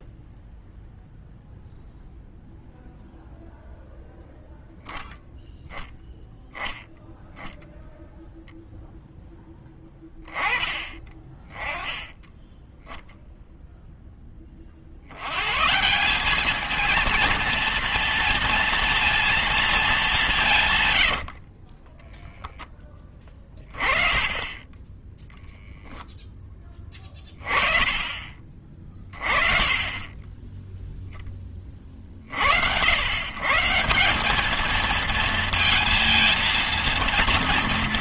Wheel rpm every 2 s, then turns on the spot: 0, 0, 0, 10, 0, 20, 10, 40, 220, 230, 140, 10, 20, 10, 30, 10, 70, 220, 230.
24-26 30-32